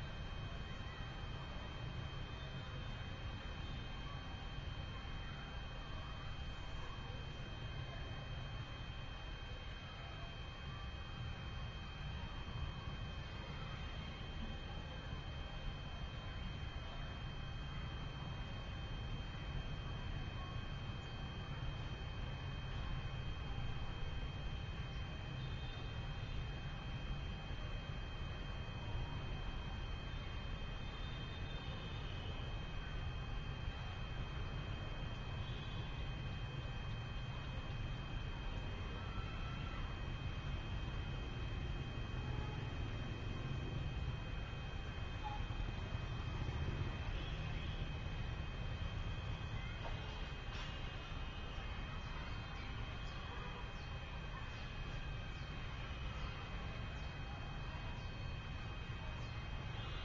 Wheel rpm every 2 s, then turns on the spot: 0, 0, 0, 0, 0, 0, 0, 0, 0, 0, 0, 0, 0, 0, 0, 0, 0, 0, 0, 0, 0, 0, 0, 0, 0, 0, 0, 0, 0, 0.
none